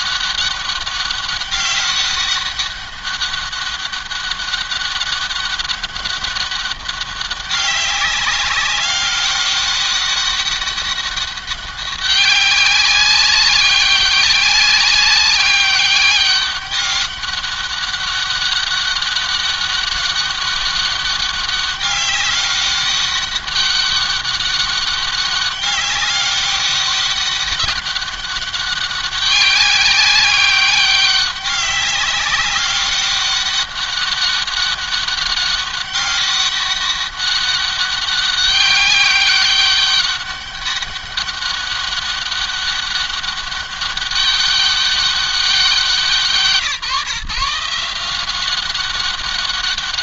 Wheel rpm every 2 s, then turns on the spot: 200, 200, 200, 200, 190, 200, 200, 200, 200, 200, 200, 200, 200, 200, 200, 200, 200, 190, 200, 200, 200, 200, 200, 170, 190.
none